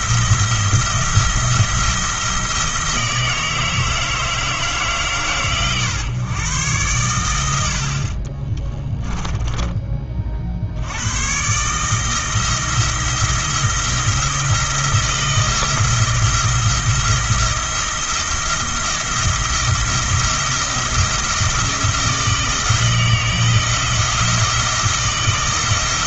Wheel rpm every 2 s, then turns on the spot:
170, 170, 160, 120, 40, 50, 160, 170, 170, 160, 170, 160, 170.
8-10